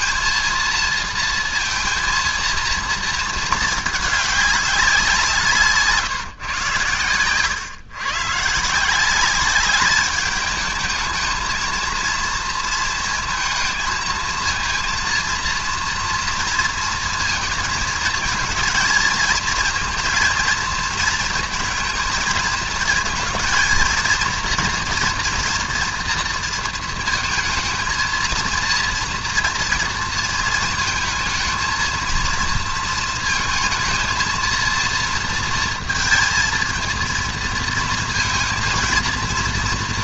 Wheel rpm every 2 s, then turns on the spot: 230, 230, 210, 130, 140, 210, 230, 220, 230, 230, 230, 230, 230, 230, 230, 230, 230, 230, 230, 230.
none